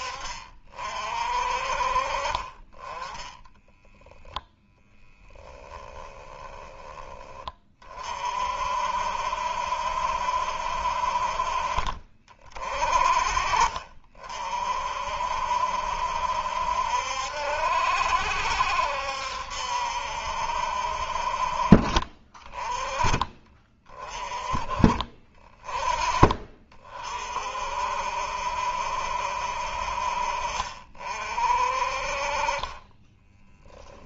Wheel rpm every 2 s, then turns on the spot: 40, 30, 10, 10, 50, 60, 50, 50, 70, 70, 60, 30, 30, 30, 60, 50, 30.
22-24